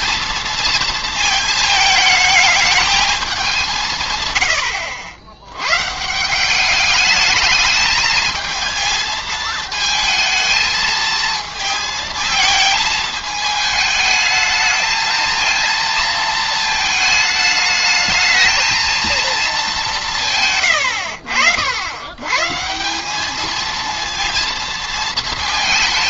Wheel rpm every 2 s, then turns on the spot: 220, 220, 80, 200, 220, 230, 220, 220, 220, 220, 110, 150, 230.
20-22